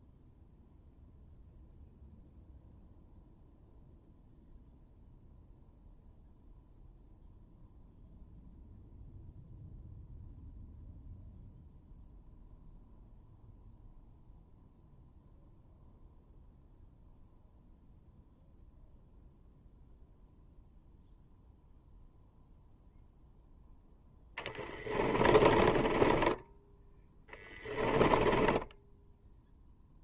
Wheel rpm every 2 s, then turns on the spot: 0, 0, 0, 0, 0, 0, 0, 0, 0, 0, 0, 0, 30, 10, 10.
24-30